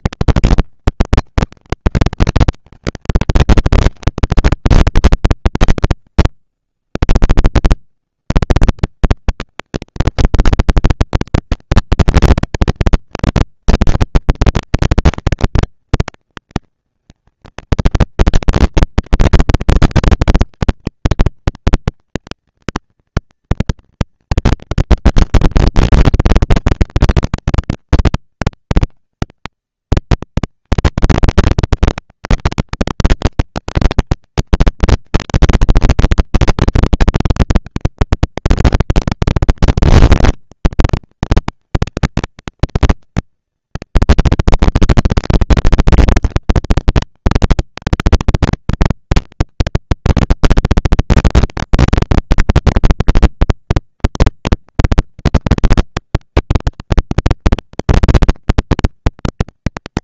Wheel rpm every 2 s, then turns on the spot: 220, 210, 200, 110, 160, 220, 220, 230, 230, 230, 230, 230, 230, 230, 220, 220, 230, 230, 230, 230, 230, 230, 240, 230, 230, 230, 200, 190, 210, 230.
none